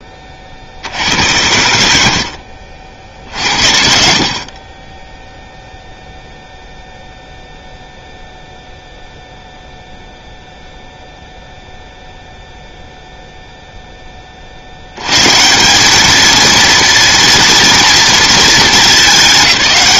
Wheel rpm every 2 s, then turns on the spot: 70, 60, 30, 0, 0, 0, 0, 90, 230, 220.
none